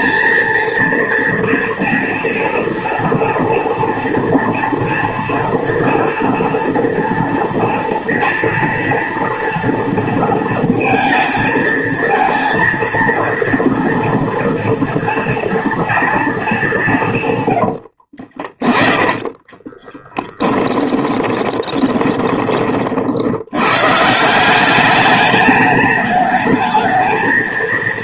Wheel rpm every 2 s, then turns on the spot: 230, 240, 230, 230, 230, 230, 230, 230, 200, 30, 10, 40, 190, 220.
18-22